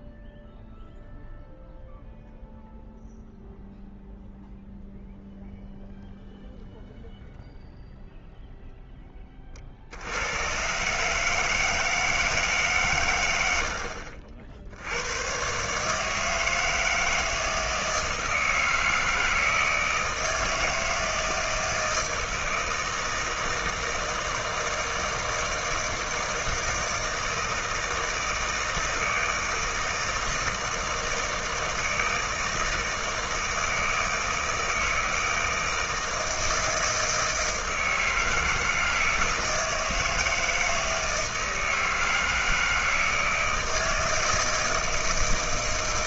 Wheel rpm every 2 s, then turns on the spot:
0, 0, 0, 0, 0, 130, 150, 70, 160, 160, 160, 160, 160, 160, 160, 160, 160, 160, 160, 160, 160, 160, 160.
none